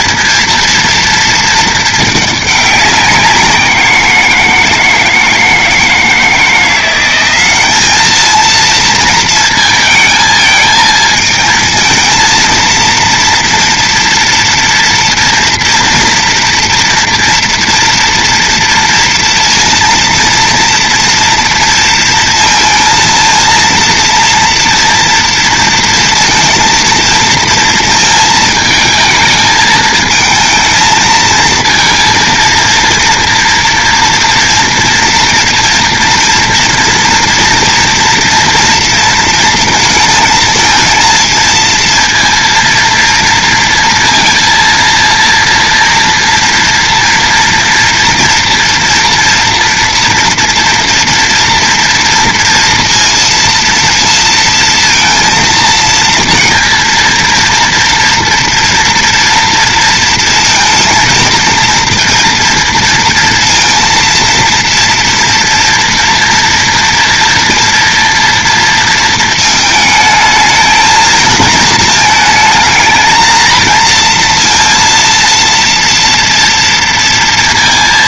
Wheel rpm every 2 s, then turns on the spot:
230, 210, 170, 170, 230, 220, 230, 240, 230, 230, 230, 230, 230, 230, 220, 220, 230, 240, 230, 230, 220, 230, 230, 240, 240, 230, 230, 230, 230, 230, 230, 230, 230, 230, 230, 220, 220, 230, 230.
none